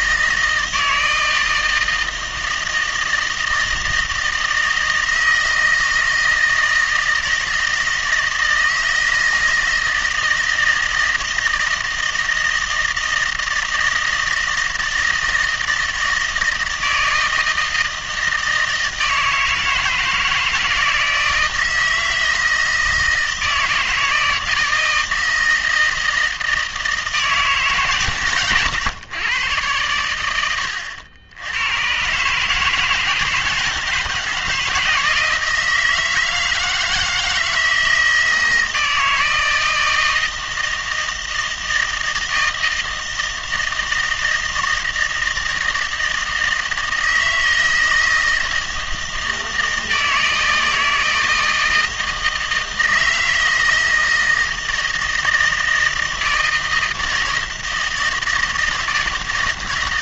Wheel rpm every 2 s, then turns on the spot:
160, 160, 160, 160, 160, 160, 160, 160, 160, 160, 160, 160, 160, 160, 120, 90, 160, 160, 160, 160, 160, 160, 160, 160, 160, 160, 160, 160, 160, 160.
30-32